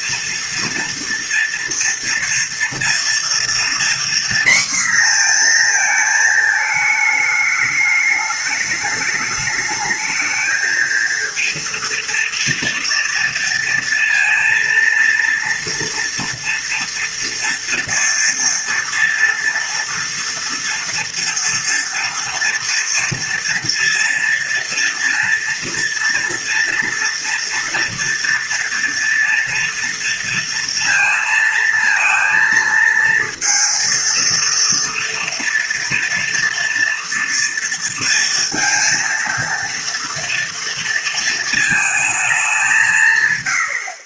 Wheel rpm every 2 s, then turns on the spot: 230, 230, 240, 210, 210, 230, 230, 230, 230, 230, 230, 230, 230, 230, 230, 230, 230, 230, 230, 230, 230, 140.
none